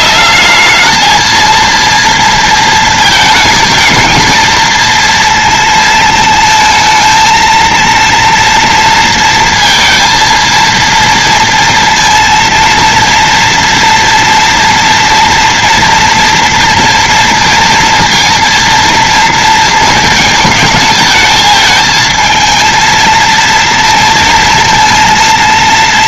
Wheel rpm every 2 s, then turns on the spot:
210, 230, 230, 230, 230, 230, 230, 230, 230, 230, 220, 230, 230.
none